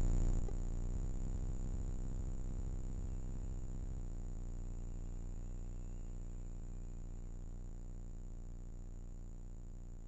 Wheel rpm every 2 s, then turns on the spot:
70, 90, 140, 10, 10.
6-8